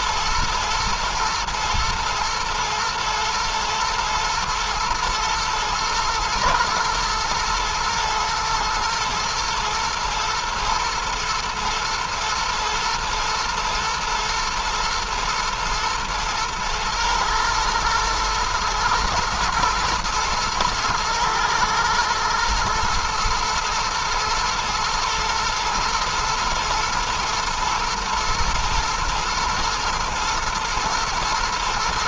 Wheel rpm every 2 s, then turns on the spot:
110, 110, 120, 120, 110, 110, 110, 110, 120, 110, 110, 120, 110, 110, 120, 120.
none